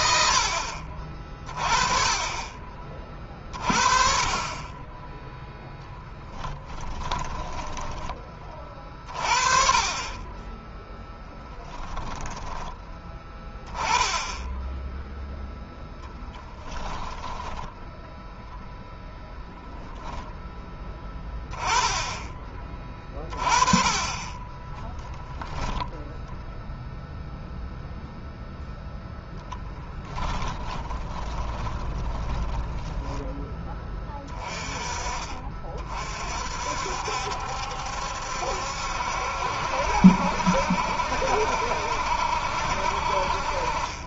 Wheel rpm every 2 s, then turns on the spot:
60, 30, 20, 10, 30, 10, 10, 0, 20, 0, 10, 20, 10, 0, 0, 10, 10, 30, 60, 70, 60, 60.
6-8 16-18 30-32